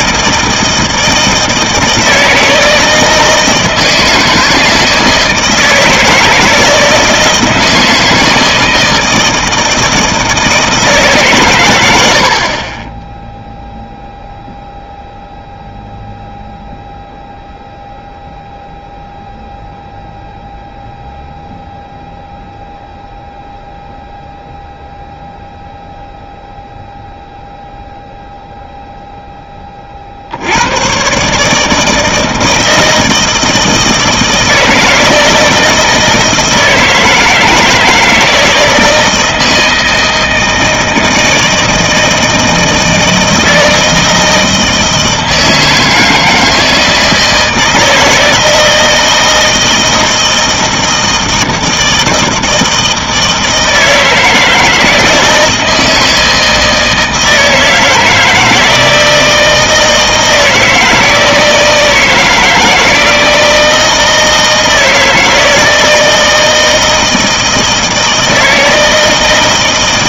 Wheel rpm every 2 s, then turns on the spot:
160, 160, 160, 160, 160, 170, 30, 0, 0, 0, 0, 0, 0, 0, 0, 90, 160, 160, 160, 160, 160, 160, 160, 160, 160, 160, 160, 160, 160, 160, 160, 160, 160, 160, 160.
none